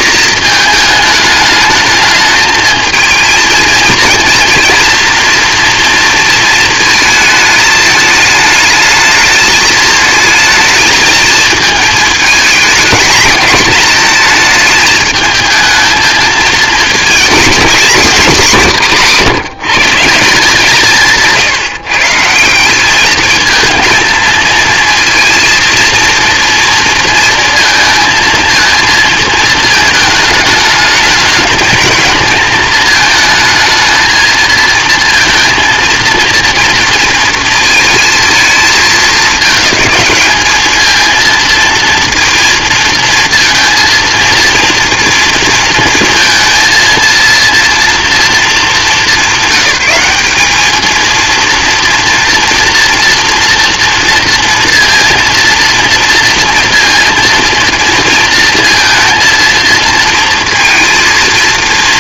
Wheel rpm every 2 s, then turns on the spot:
220, 220, 240, 230, 220, 230, 230, 210, 230, 170, 160, 200, 230, 230, 220, 210, 220, 230, 230, 220, 220, 230, 230, 230, 220, 220, 230, 230, 230, 230, 230.
none